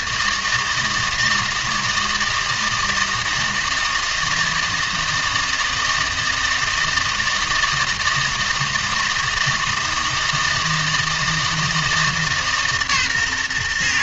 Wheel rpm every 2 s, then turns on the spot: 160, 160, 160, 160, 160, 160, 140.
none